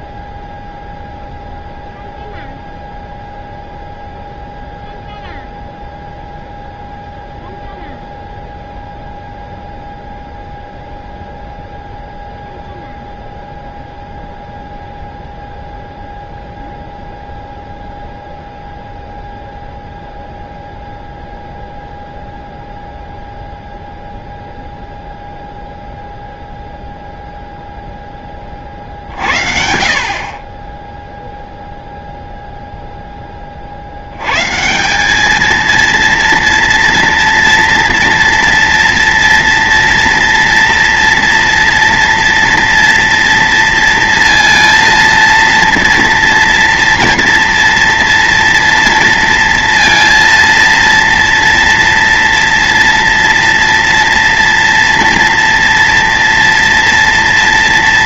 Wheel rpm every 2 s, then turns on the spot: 0, 0, 0, 0, 0, 0, 0, 0, 0, 0, 0, 0, 0, 0, 30, 20, 0, 160, 230, 240, 230, 230, 230, 230, 230, 230, 230, 230, 230.
none